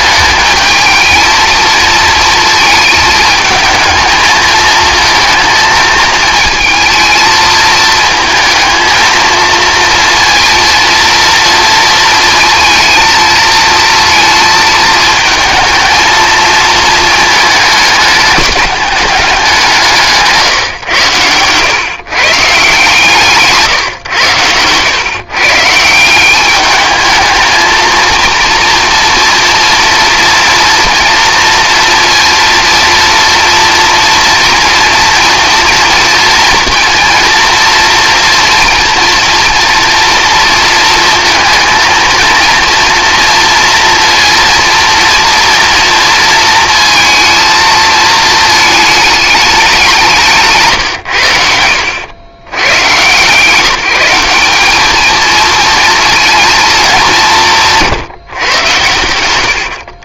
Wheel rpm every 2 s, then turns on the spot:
220, 220, 220, 230, 220, 230, 230, 220, 220, 210, 140, 140, 110, 200, 230, 230, 230, 230, 240, 230, 230, 230, 230, 220, 220, 150, 140, 200, 220, 120.
50-52